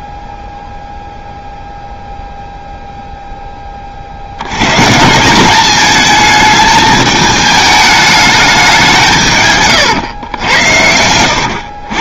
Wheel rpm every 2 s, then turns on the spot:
0, 0, 120, 220, 200, 90.
none